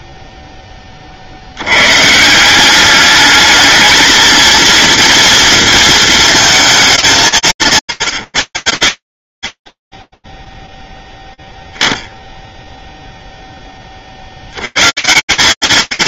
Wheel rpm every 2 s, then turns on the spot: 20, 190, 230, 220, 80, 0, 0, 100.
none